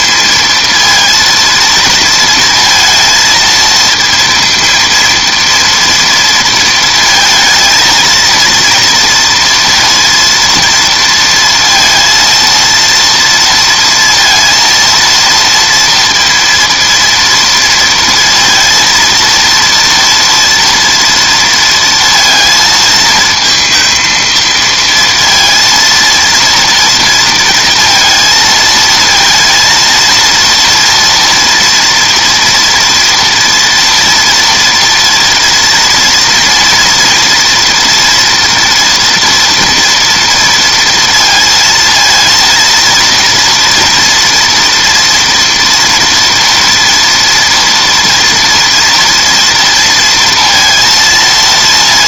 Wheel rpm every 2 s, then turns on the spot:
230, 230, 230, 230, 230, 230, 230, 230, 230, 230, 230, 220, 230, 230, 220, 230, 230, 230, 230, 230, 230, 230, 230, 240, 230, 230.
none